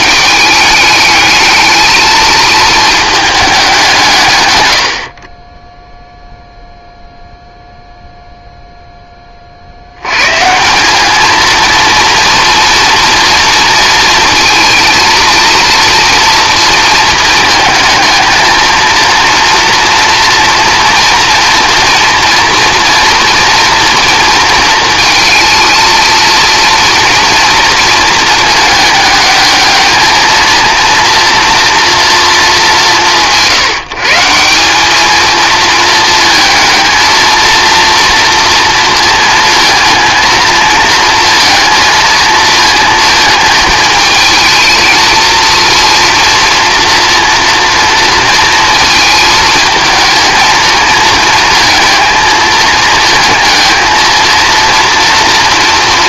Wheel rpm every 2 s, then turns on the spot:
210, 220, 100, 0, 0, 170, 230, 230, 230, 230, 230, 240, 220, 230, 220, 230, 190, 190, 220, 230, 230, 230, 220, 240, 230, 220, 220, 230.
none